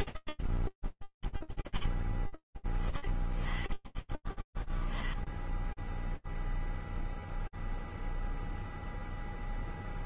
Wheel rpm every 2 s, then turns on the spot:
30, 0, 0, 0, 0.
none